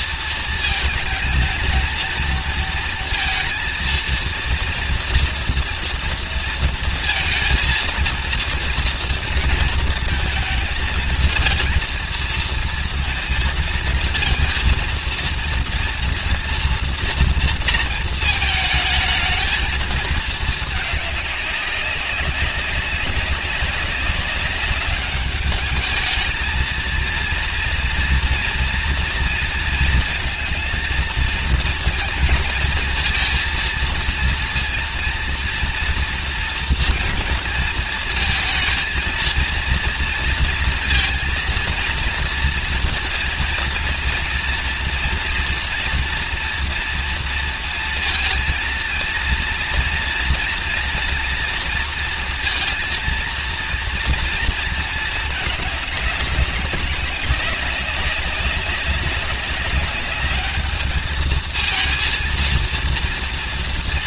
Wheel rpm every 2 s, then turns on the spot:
220, 230, 230, 230, 230, 230, 230, 230, 230, 220, 210, 190, 200, 230, 230, 220, 230, 230, 230, 230, 230, 230, 230, 230, 230, 230, 230, 220, 200, 200, 210, 230.
none